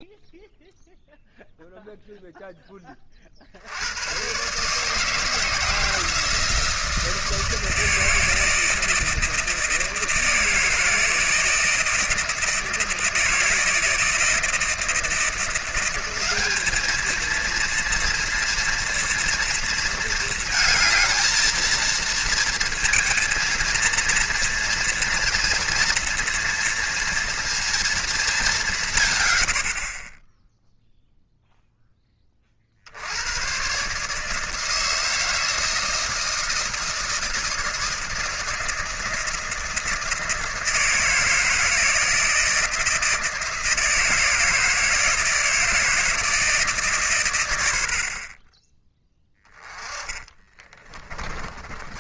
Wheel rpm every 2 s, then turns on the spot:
0, 10, 140, 160, 160, 160, 160, 160, 210, 230, 220, 230, 240, 230, 180, 10, 50, 160, 160, 160, 160, 160, 160, 150, 20, 30.
50-52